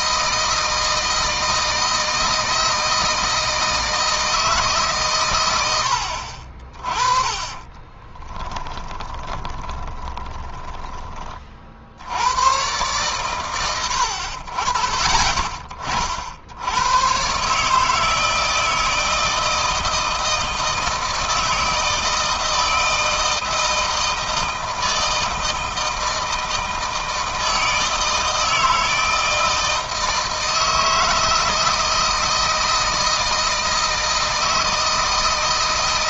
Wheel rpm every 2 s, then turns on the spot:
160, 160, 140, 30, 10, 20, 130, 50, 100, 160, 160, 160, 160, 160, 160, 160, 160, 160.
8-10